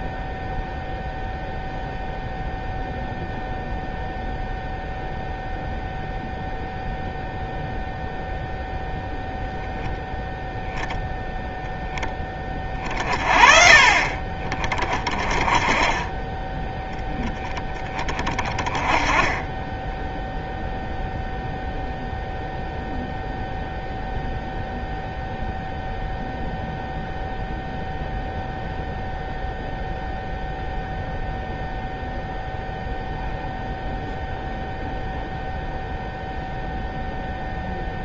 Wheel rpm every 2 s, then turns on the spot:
0, 0, 0, 0, 0, 0, 50, 30, 0, 20, 0, 0, 0, 0, 0, 0, 0, 0, 0.
none